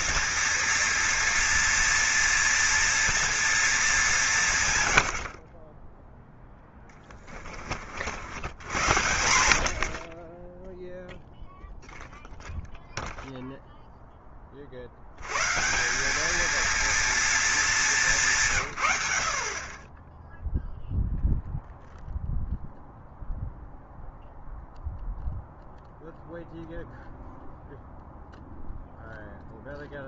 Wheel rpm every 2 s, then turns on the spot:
230, 230, 110, 10, 90, 0, 0, 60, 230, 110, 0, 0, 0, 0, 0.
none